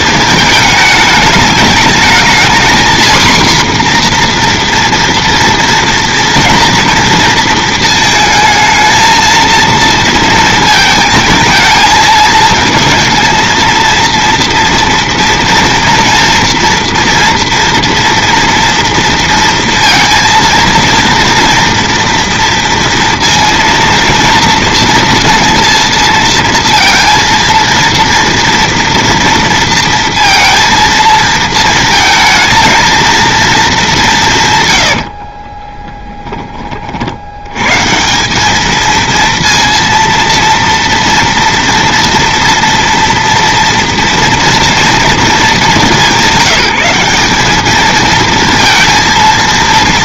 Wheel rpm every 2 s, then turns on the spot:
220, 230, 240, 230, 220, 220, 220, 230, 240, 230, 230, 230, 230, 230, 230, 230, 220, 130, 30, 210, 230, 230, 230, 180, 230.
none